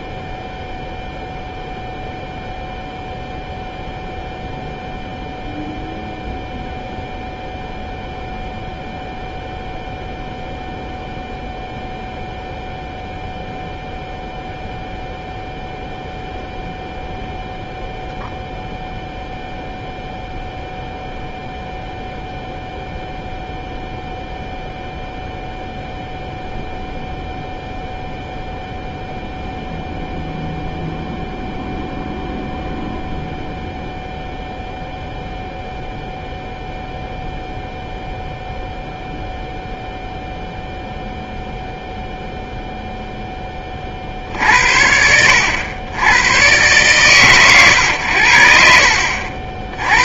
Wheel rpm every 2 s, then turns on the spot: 0, 0, 0, 0, 0, 0, 0, 0, 0, 0, 0, 0, 0, 0, 0, 0, 0, 0, 0, 0, 0, 0, 60, 130, 60.
none